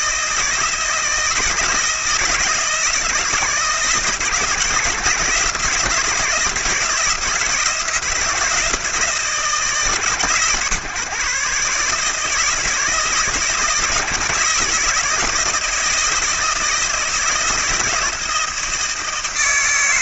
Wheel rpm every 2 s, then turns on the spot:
160, 160, 160, 160, 160, 150, 160, 160, 160, 170.
none